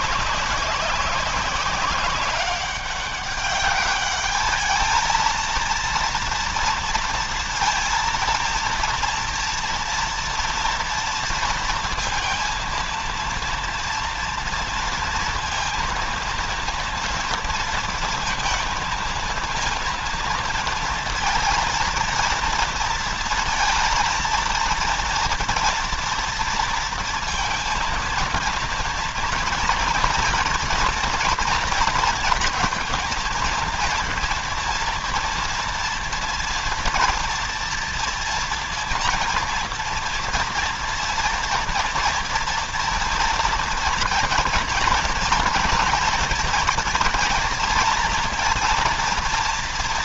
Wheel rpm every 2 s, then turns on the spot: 190, 200, 220, 230, 230, 230, 230, 230, 230, 220, 230, 230, 230, 230, 230, 230, 230, 230, 240, 230, 230, 230, 230, 230, 230.
none